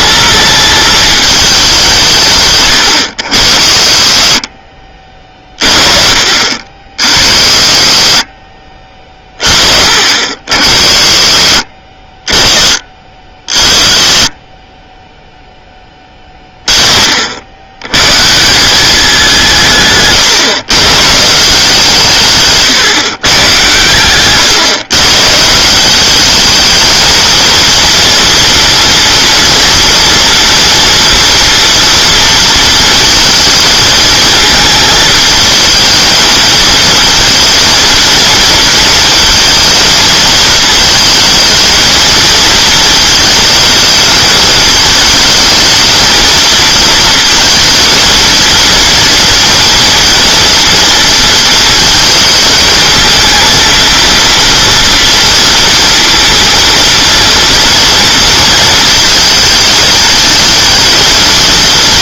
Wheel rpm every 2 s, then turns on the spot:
220, 120, 40, 60, 40, 50, 30, 20, 30, 180, 130, 140, 130, 210, 240, 240, 220, 220, 220, 230, 220, 220, 220, 230, 230, 230, 220, 230, 230, 230, 220.
4-6 8-10 22-24